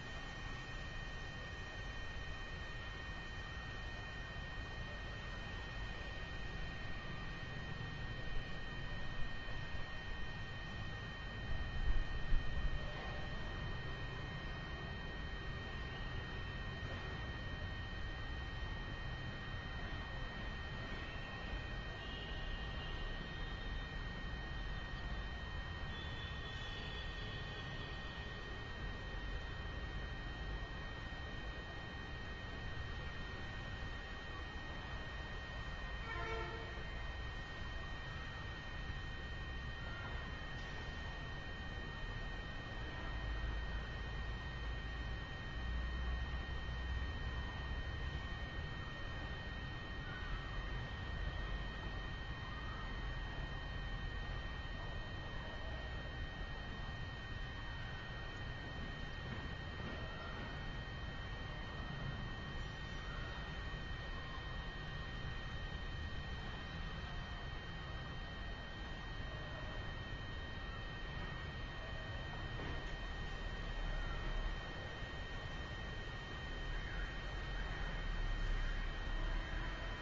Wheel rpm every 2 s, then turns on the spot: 0, 0, 0, 0, 0, 0, 0, 0, 0, 0, 0, 0, 0, 0, 0, 0, 0, 0, 0, 0, 0, 0, 0, 0, 0, 0, 0, 0, 0, 0, 0, 0, 0, 0, 0, 0, 0, 0, 0, 0.
none